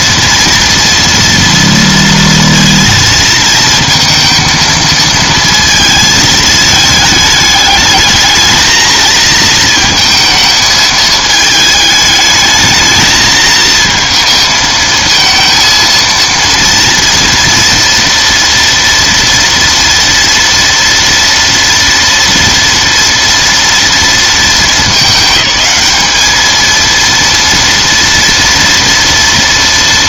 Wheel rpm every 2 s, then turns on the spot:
240, 230, 230, 220, 220, 220, 220, 230, 230, 230, 230, 230, 210, 210, 230.
none